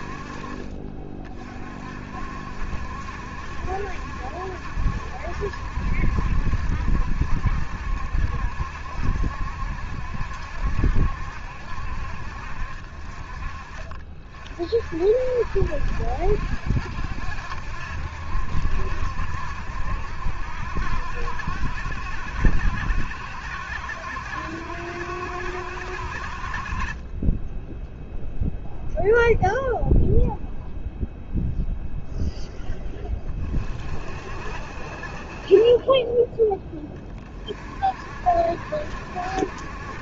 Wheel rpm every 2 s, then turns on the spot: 30, 70, 70, 70, 70, 70, 30, 60, 70, 70, 70, 70, 70, 20, 0, 0, 20, 50, 20, 70.
none